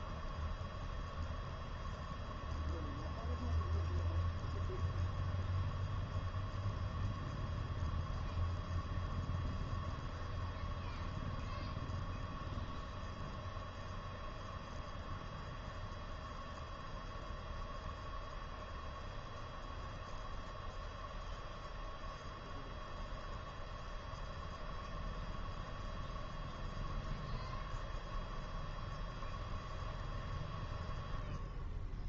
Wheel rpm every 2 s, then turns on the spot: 0, 0, 0, 0, 0, 0, 0, 0, 0, 0, 0, 0, 0, 0, 0, 0.
none